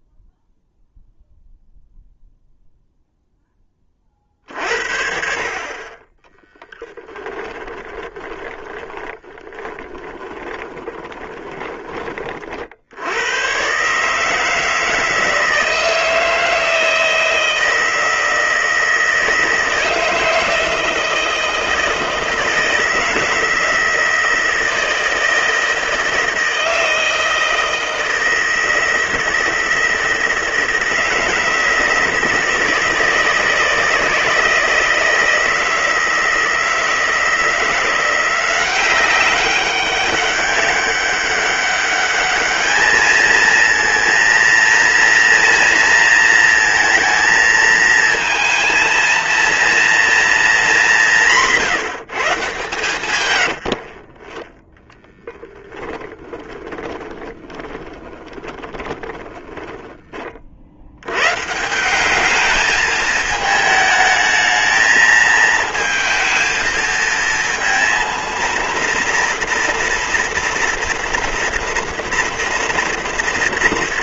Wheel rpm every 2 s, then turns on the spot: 0, 0, 50, 10, 30, 20, 100, 160, 160, 160, 160, 160, 160, 160, 160, 160, 160, 160, 160, 190, 200, 220, 230, 230, 230, 200, 120, 10, 20, 20, 100, 220, 220, 230, 230, 230, 230.
6-12 52-54 56-60